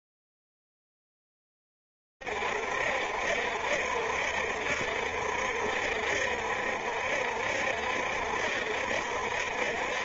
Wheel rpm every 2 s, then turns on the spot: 0, 50, 60, 60, 70.
none